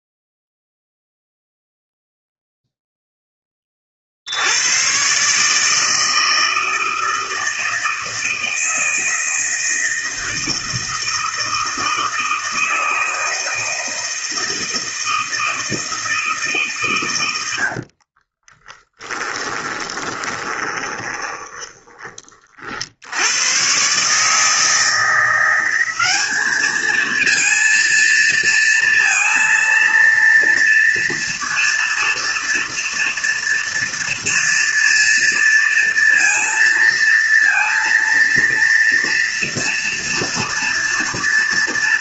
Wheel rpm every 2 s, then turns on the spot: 0, 0, 120, 160, 160, 160, 160, 160, 130, 20, 30, 70, 170, 220, 230, 230, 230, 230, 230, 230, 230.
18-22